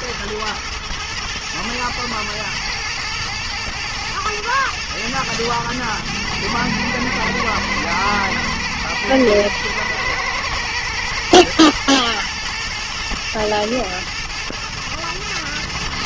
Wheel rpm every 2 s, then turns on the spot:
120, 110, 110, 110, 110, 110, 120, 110.
none